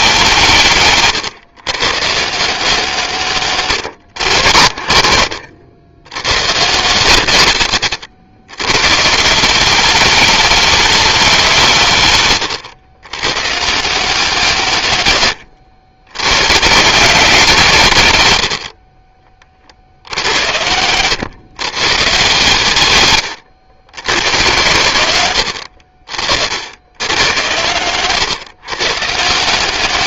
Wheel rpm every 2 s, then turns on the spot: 120, 120, 70, 130, 190, 180, 140, 90, 160, 50, 120, 100, 80, 100, 180.
24-26